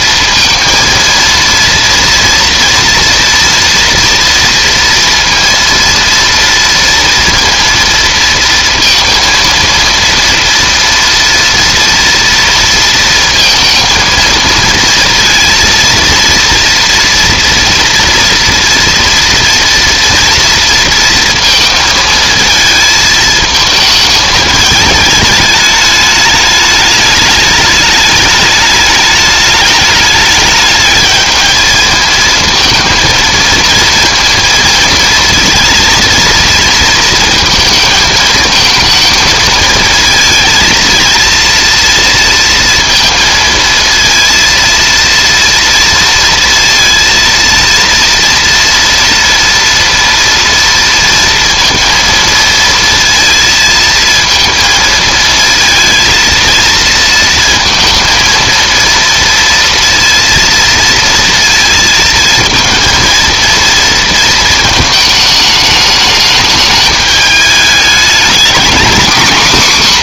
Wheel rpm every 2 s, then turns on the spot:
230, 230, 230, 230, 230, 230, 230, 230, 230, 230, 230, 220, 220, 210, 220, 210, 230, 230, 230, 220, 230, 230, 230, 230, 230, 230, 230, 230, 230, 230, 230, 230, 220, 210, 230.
none